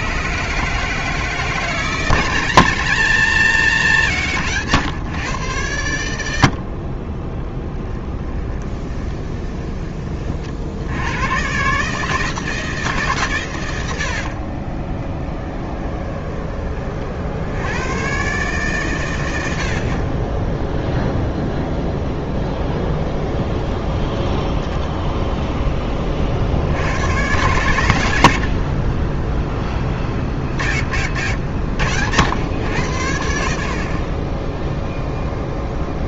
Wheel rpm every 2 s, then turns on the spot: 150, 170, 140, 60, 20, 70, 160, 30, 30, 130, 0, 10, 0, 80, 40, 60, 100, 0.
8-10 14-16 22-24